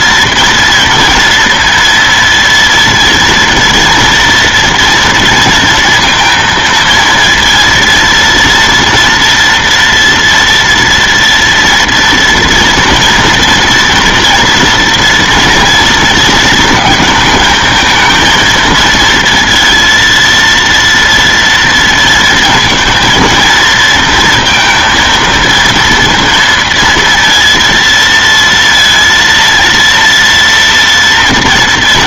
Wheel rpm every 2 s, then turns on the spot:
230, 230, 230, 230, 230, 230, 230, 230, 220, 230, 230, 230, 230, 230, 230, 230.
none